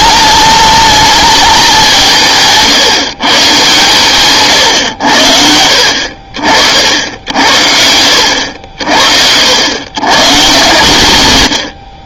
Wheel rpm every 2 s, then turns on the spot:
220, 150, 120, 50, 70, 120.
none